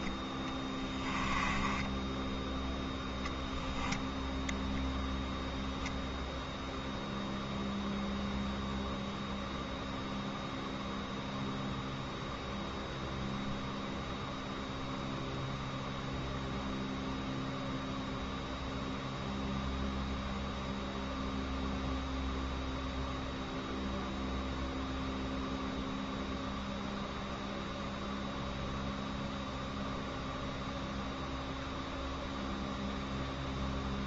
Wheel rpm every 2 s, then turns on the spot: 10, 0, 0, 0, 0, 0, 0, 0, 0, 0, 0, 0, 0, 0, 0, 0, 0.
0-2